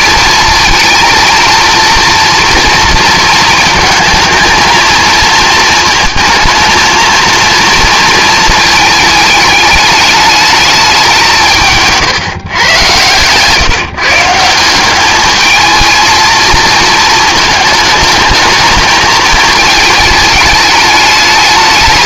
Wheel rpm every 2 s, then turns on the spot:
230, 230, 230, 230, 220, 200, 120, 190, 230, 220, 210.
none